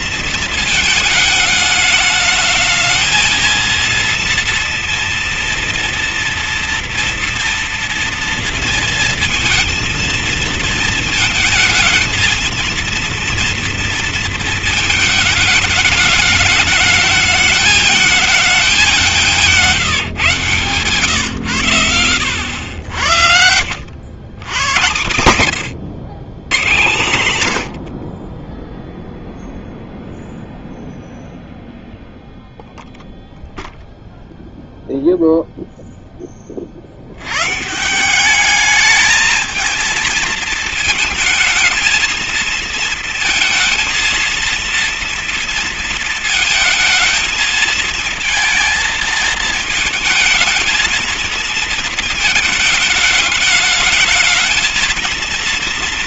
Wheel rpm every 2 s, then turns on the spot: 220, 220, 230, 240, 230, 220, 230, 230, 210, 200, 130, 80, 100, 120, 50, 0, 0, 0, 30, 200, 220, 230, 230, 230, 220, 220, 220, 220.
none